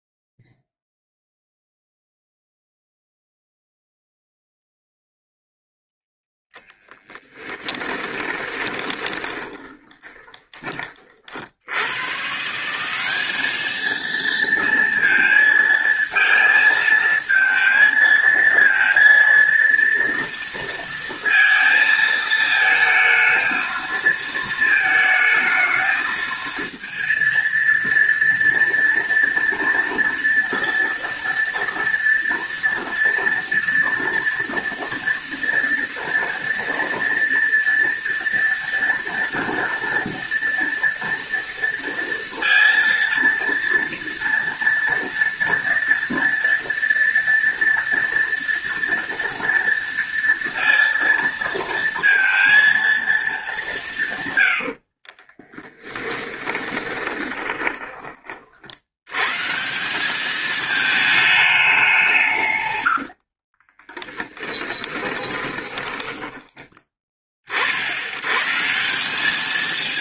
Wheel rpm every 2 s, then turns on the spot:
0, 0, 0, 10, 20, 30, 180, 230, 220, 230, 230, 220, 220, 230, 230, 230, 230, 230, 230, 230, 230, 230, 230, 230, 230, 230, 230, 60, 20, 70, 220, 90, 20, 20, 170.
6-10 54-58 62-66